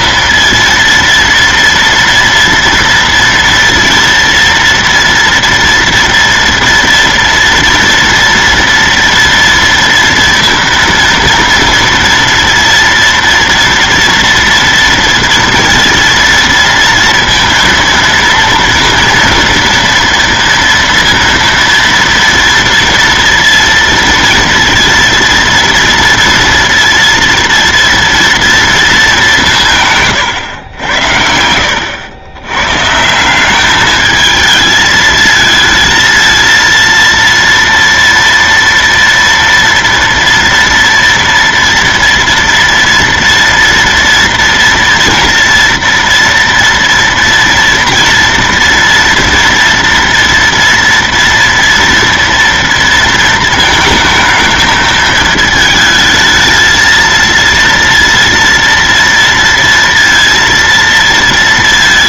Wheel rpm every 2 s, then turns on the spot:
230, 230, 230, 230, 230, 230, 230, 230, 230, 230, 230, 230, 230, 230, 230, 110, 120, 220, 230, 230, 230, 230, 230, 230, 230, 230, 230, 220, 220, 230, 230.
none